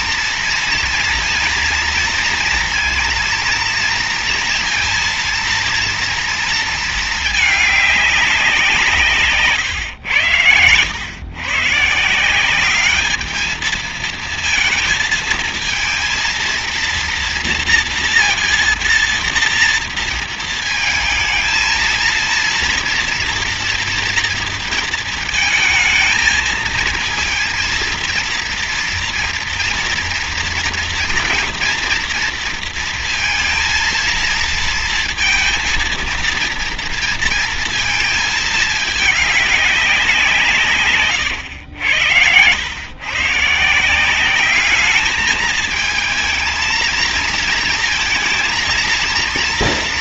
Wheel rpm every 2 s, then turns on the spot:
230, 230, 230, 220, 160, 100, 210, 220, 230, 230, 220, 230, 230, 230, 230, 230, 230, 230, 230, 210, 120, 130, 210, 230, 230.
none